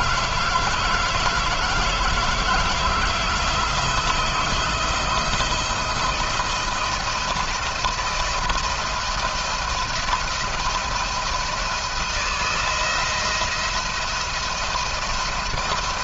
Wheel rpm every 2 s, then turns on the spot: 160, 170, 160, 170, 170, 170, 170, 170.
none